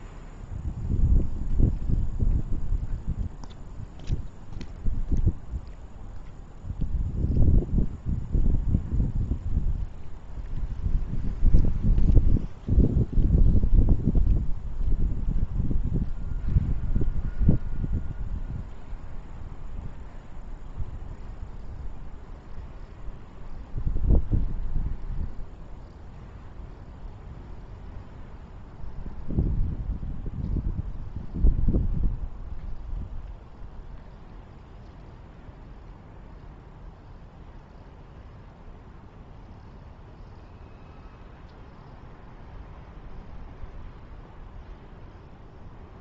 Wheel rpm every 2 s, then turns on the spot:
0, 0, 0, 0, 0, 0, 0, 0, 0, 0, 0, 0, 0, 0, 0, 0, 0, 0, 0, 0, 0, 0, 0.
none